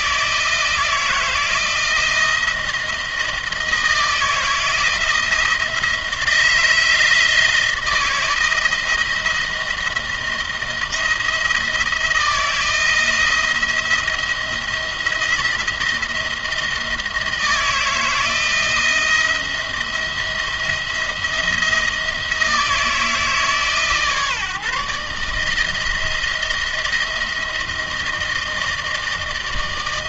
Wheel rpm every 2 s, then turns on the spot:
160, 170, 170, 170, 170, 170, 170, 170, 170, 170, 170, 160, 150, 170, 160.
none